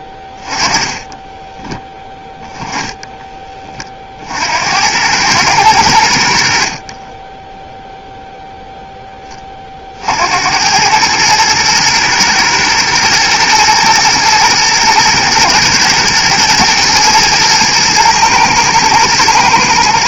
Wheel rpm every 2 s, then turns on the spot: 20, 10, 70, 60, 10, 100, 120, 110, 110, 110.
0-2